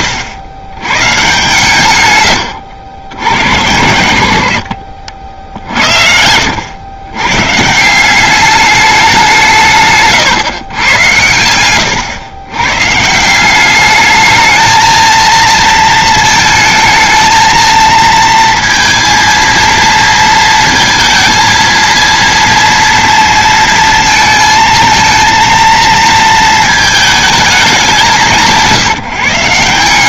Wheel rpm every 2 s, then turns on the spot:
120, 90, 70, 110, 200, 110, 140, 220, 220, 230, 230, 230, 230, 220, 180.
4-6